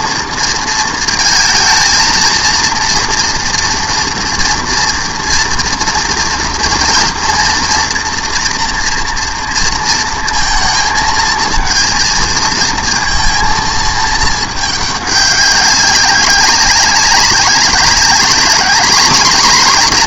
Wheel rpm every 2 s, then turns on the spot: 230, 230, 230, 230, 230, 230, 230, 210, 200, 200.
none